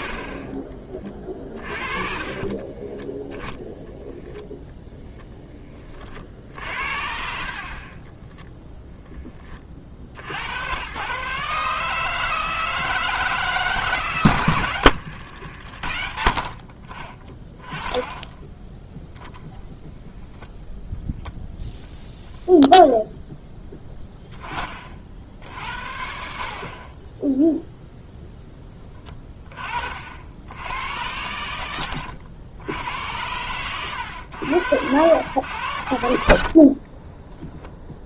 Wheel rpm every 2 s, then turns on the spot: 30, 30, 10, 60, 0, 120, 160, 100, 40, 10, 0, 0, 30, 60, 10, 90, 80, 90, 50.
2-4 14-16